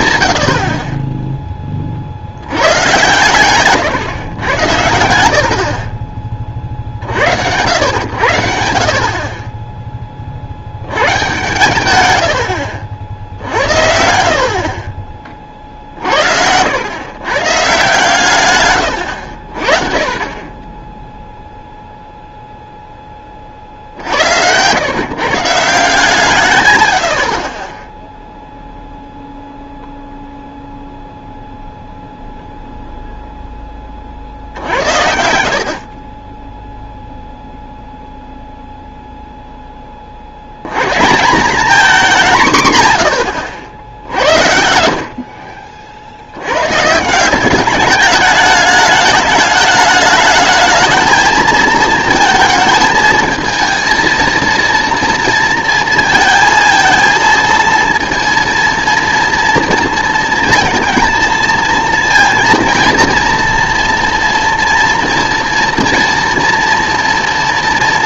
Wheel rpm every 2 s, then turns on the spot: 70, 100, 100, 40, 70, 80, 70, 50, 90, 120, 10, 0, 110, 130, 0, 0, 0, 70, 10, 0, 100, 160, 70, 110, 210, 220, 220, 230, 230, 230, 230, 230, 230, 230.
12-14 42-44